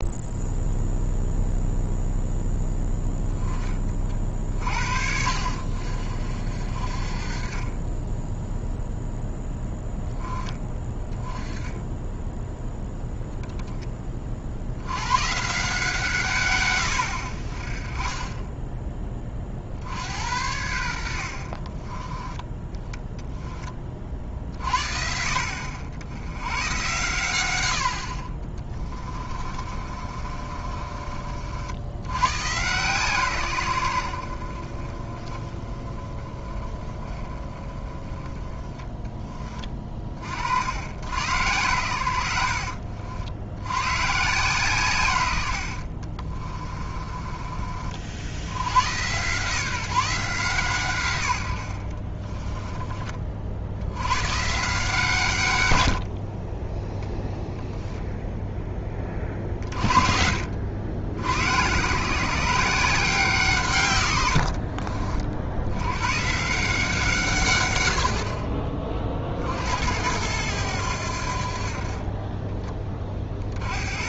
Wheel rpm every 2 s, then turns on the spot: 0, 0, 50, 50, 0, 10, 0, 80, 90, 20, 80, 10, 50, 110, 30, 40, 130, 60, 20, 20, 60, 70, 140, 30, 100, 150, 20, 160, 10, 10, 70, 170, 50, 170, 30, 90, 20.
28-32 46-48 64-66